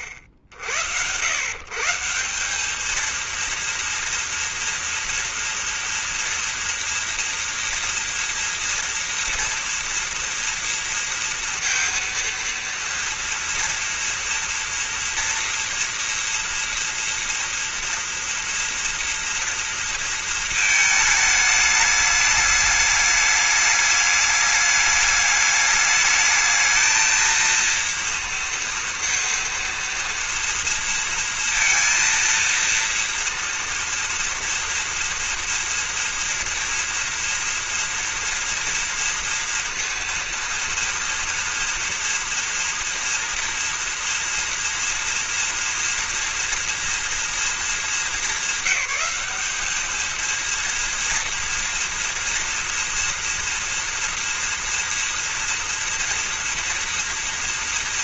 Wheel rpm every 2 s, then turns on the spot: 70, 190, 230, 230, 240, 230, 230, 240, 230, 240, 220, 210, 210, 220, 230, 230, 230, 230, 230, 230, 230, 230, 230, 230, 200, 230, 230, 230, 230.
none